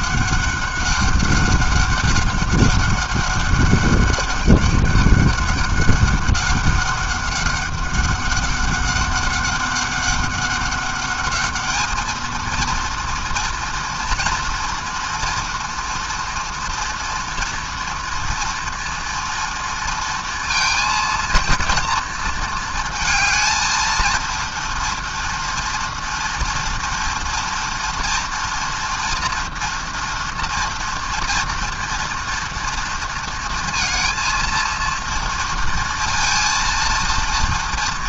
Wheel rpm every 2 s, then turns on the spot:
200, 200, 200, 200, 200, 200, 220, 230, 230, 230, 230, 230, 230, 230, 230, 230, 230, 230, 230.
none